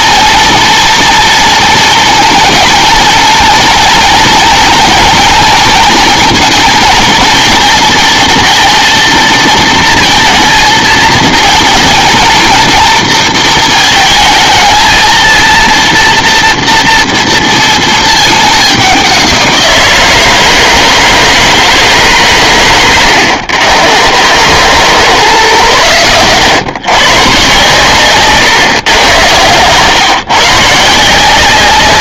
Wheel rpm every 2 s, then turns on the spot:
230, 230, 230, 220, 230, 230, 230, 220, 230, 200, 160, 110, 120, 130, 120, 160.
none